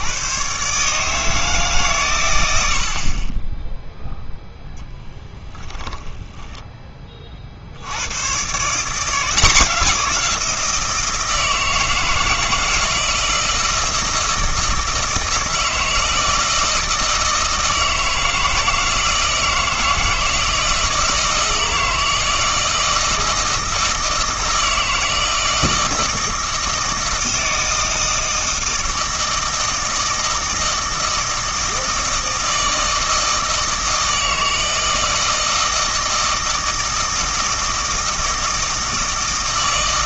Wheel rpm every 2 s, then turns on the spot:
130, 80, 0, 10, 150, 170, 160, 160, 160, 160, 160, 160, 160, 160, 160, 160, 160, 160, 160, 160.
none